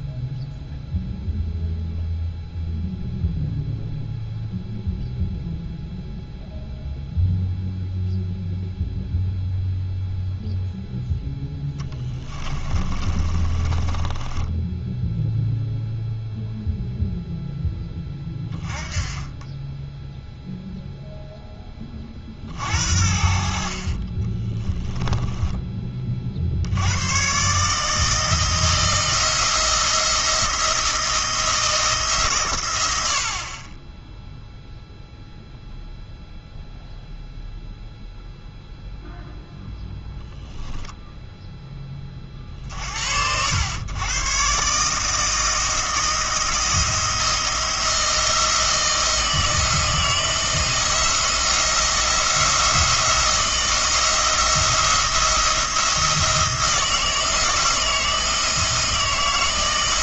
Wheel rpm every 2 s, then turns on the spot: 0, 0, 0, 0, 0, 0, 30, 10, 0, 20, 0, 60, 10, 90, 170, 170, 90, 0, 0, 0, 0, 70, 150, 160, 170, 170, 170, 170, 160, 160.
12-16 24-26